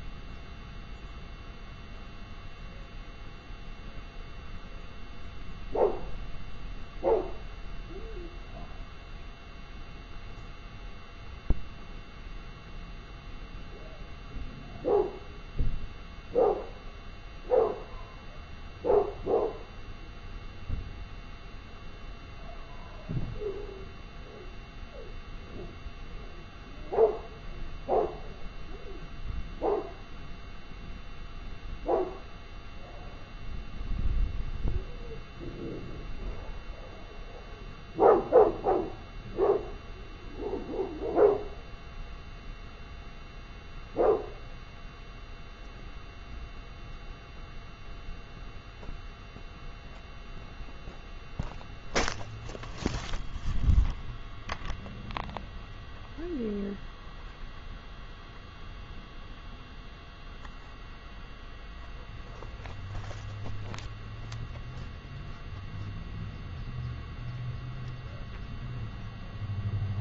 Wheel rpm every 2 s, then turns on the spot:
0, 0, 0, 0, 0, 0, 0, 0, 0, 0, 0, 0, 0, 0, 0, 0, 0, 0, 0, 0, 0, 0, 0, 0, 0, 0, 0, 0, 0, 0, 0, 0, 0, 0, 0.
none